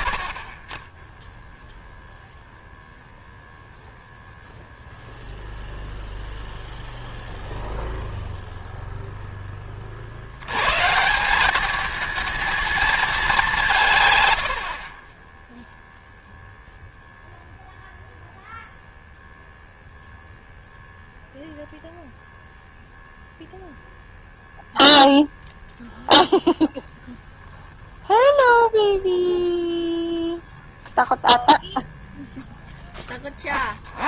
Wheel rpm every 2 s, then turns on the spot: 30, 0, 0, 0, 0, 130, 220, 80, 0, 0, 0, 0, 0, 0, 0, 0, 10.
14-16